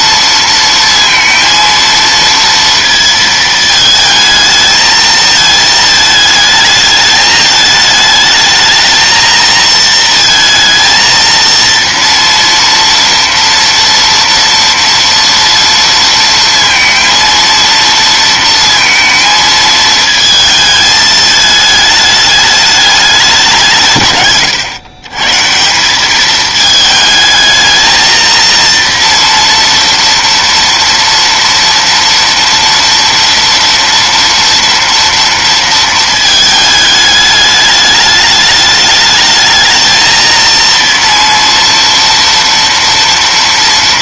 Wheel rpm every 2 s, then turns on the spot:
230, 220, 220, 220, 230, 230, 230, 230, 230, 220, 210, 180, 150, 220, 240, 230, 230, 230, 210, 220, 230, 230.
none